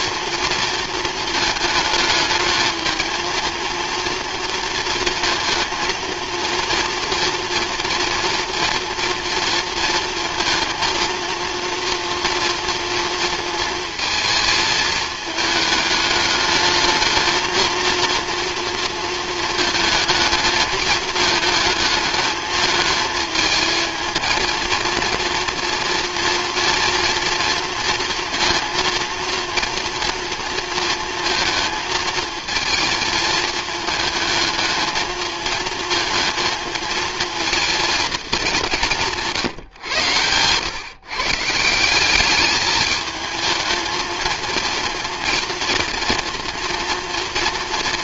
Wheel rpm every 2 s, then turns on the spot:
230, 220, 230, 240, 230, 230, 230, 220, 220, 230, 220, 220, 230, 240, 230, 230, 230, 220, 220, 190, 130, 210, 230, 240.
none